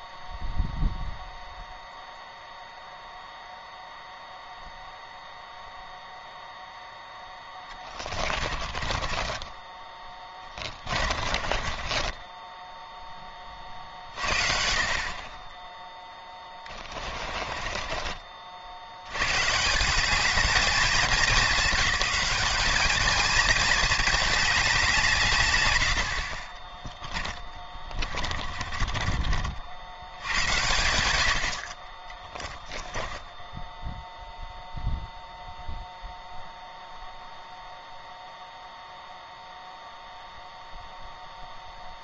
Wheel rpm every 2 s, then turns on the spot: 0, 0, 0, 0, 30, 30, 0, 50, 20, 100, 210, 220, 170, 20, 30, 100, 10, 0, 0, 0, 0.
8-12 16-18 26-30 32-34